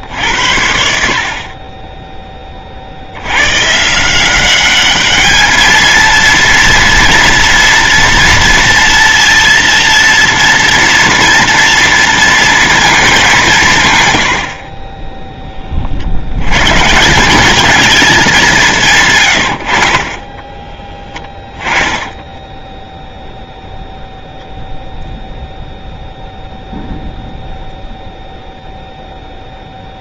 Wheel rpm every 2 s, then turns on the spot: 30, 30, 190, 230, 230, 230, 230, 60, 110, 180, 20, 0, 0, 0, 0.
20-22